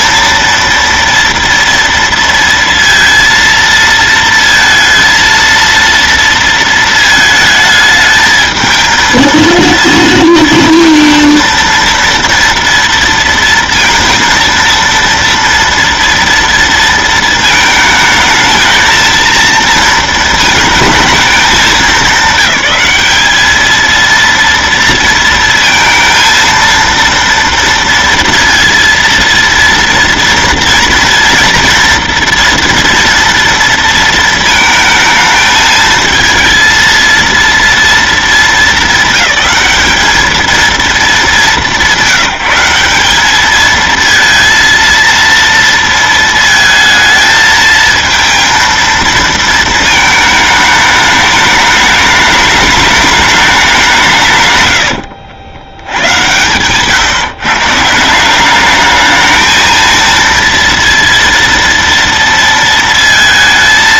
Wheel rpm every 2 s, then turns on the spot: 230, 230, 230, 230, 220, 230, 230, 230, 230, 220, 220, 210, 230, 230, 230, 230, 240, 220, 230, 220, 230, 180, 230, 220, 230, 210, 210, 130, 120, 200, 230, 230.
54-56